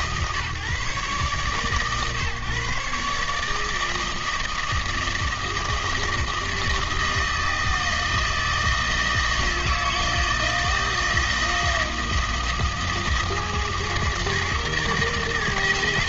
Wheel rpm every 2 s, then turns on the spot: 140, 160, 160, 160, 160, 160, 160, 160.
none